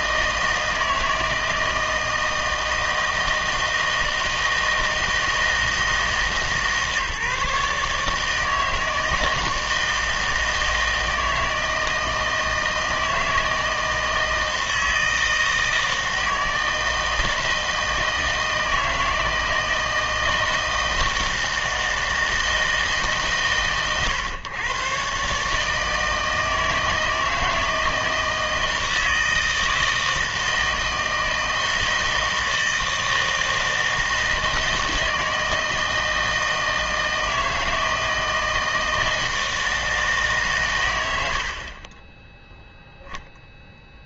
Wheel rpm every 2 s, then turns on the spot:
160, 160, 160, 150, 160, 160, 160, 160, 160, 160, 160, 160, 130, 160, 160, 160, 160, 160, 160, 160, 120, 0.
none